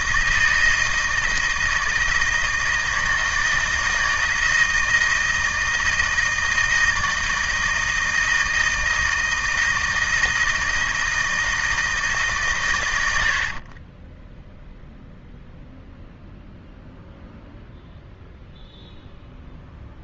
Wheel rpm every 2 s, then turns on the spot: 160, 160, 160, 160, 160, 160, 120, 0, 0, 0.
none